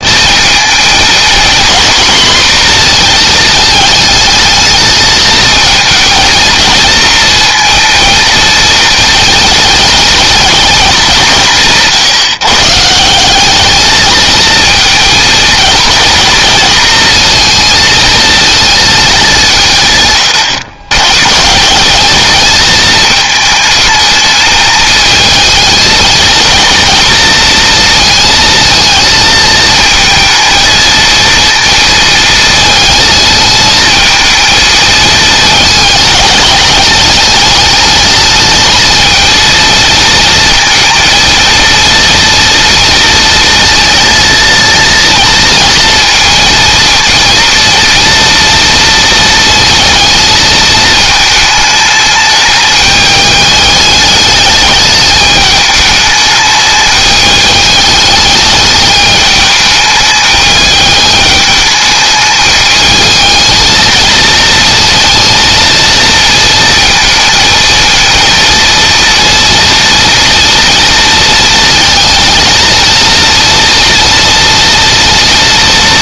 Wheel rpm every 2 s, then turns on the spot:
230, 240, 220, 230, 220, 200, 150, 230, 230, 220, 120, 220, 220, 230, 220, 230, 220, 220, 210, 220, 230, 230, 230, 230, 230, 220, 210, 210, 210, 210, 210, 220, 230, 230, 230, 230, 230, 230.
none